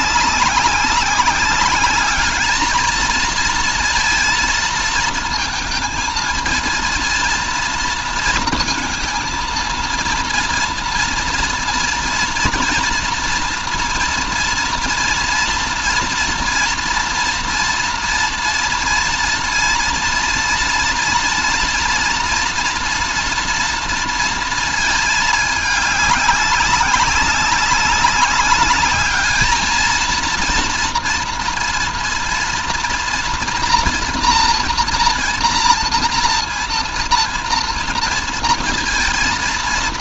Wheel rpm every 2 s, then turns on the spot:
200, 220, 230, 230, 230, 230, 240, 230, 230, 230, 230, 230, 210, 200, 210, 230, 240, 240, 230, 230.
none